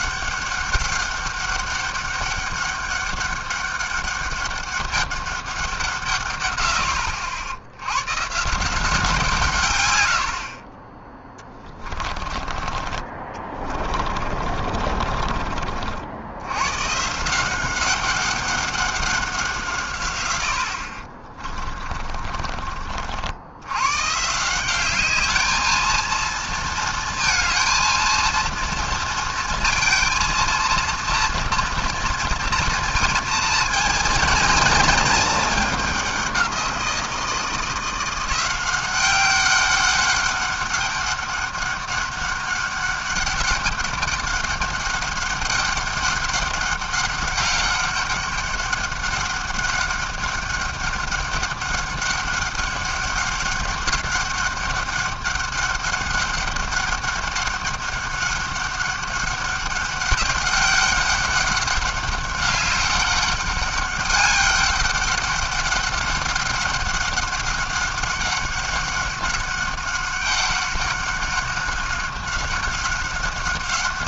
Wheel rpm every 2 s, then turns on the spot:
190, 200, 200, 100, 160, 40, 30, 40, 100, 200, 70, 40, 180, 230, 230, 230, 230, 230, 180, 180, 200, 200, 200, 200, 200, 200, 200, 200, 200, 200, 200, 200, 200, 190, 190, 200, 190.
12-16 22-24